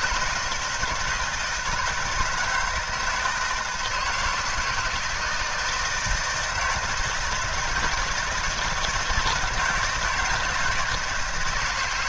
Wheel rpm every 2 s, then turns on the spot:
160, 160, 160, 170, 160, 160.
none